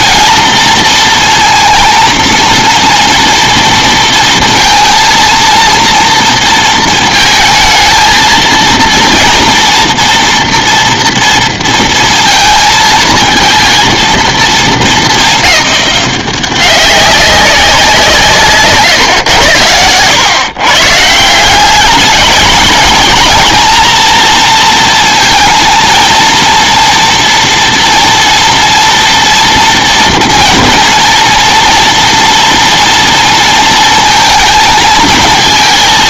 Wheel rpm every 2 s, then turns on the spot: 230, 230, 230, 230, 230, 230, 220, 220, 190, 140, 130, 220, 230, 230, 230, 230, 230, 230.
none